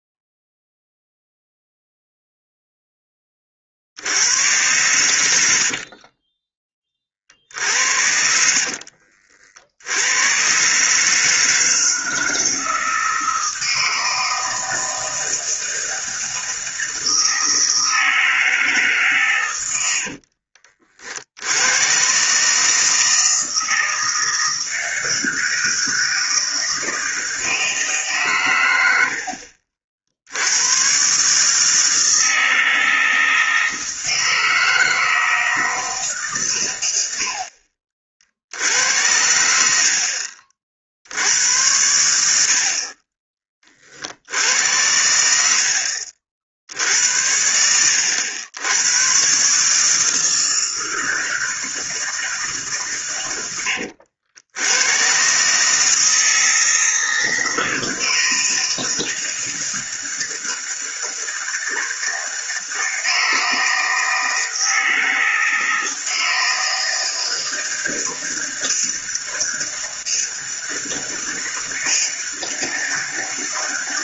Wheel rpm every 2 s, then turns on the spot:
0, 0, 100, 20, 70, 110, 160, 160, 160, 160, 60, 140, 160, 160, 120, 80, 160, 160, 120, 60, 50, 60, 70, 60, 90, 160, 150, 90, 160, 160, 160, 160, 160, 160, 160, 160, 160.
8-10 20-22